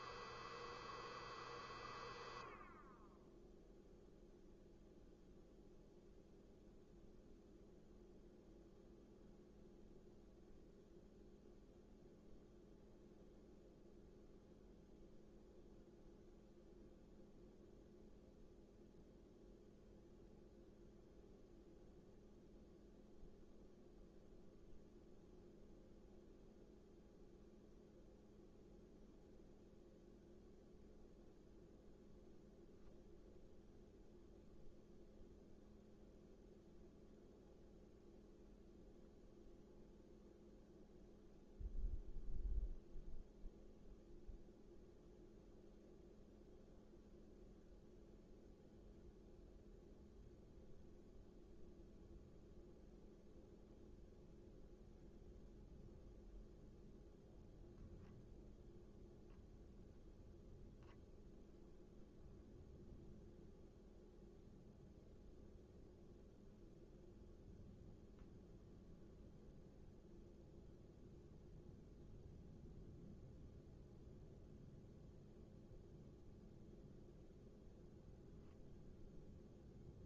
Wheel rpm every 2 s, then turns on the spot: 0, 0, 0, 0, 0, 0, 0, 0, 0, 0, 0, 0, 0, 0, 0, 0, 0, 0, 0, 0, 0, 0, 0, 0, 0, 0, 0, 0, 0, 0, 0, 0, 0, 0, 0, 0, 0, 0, 0, 0.
none